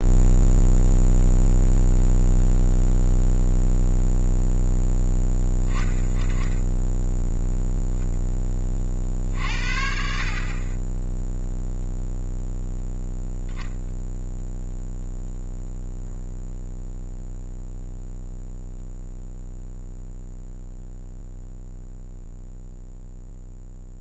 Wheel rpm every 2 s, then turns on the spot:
0, 0, 0, 10, 40, 30, 0, 0, 0, 0, 0, 0.
none